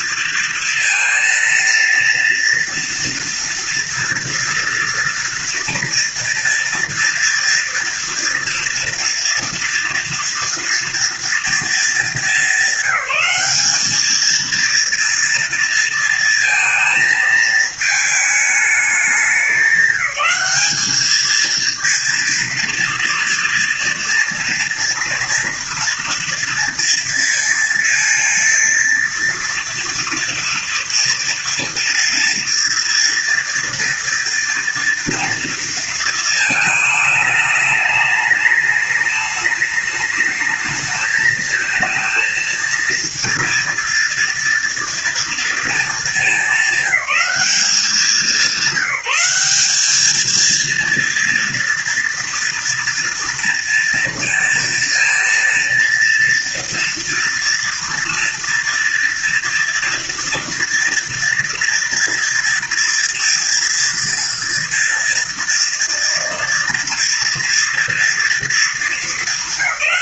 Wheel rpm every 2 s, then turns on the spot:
230, 230, 230, 230, 230, 230, 200, 230, 230, 200, 210, 230, 230, 230, 230, 230, 230, 230, 220, 210, 220, 220, 230, 200, 180, 230, 230, 230, 230, 230, 230, 230, 230, 230, 220.
none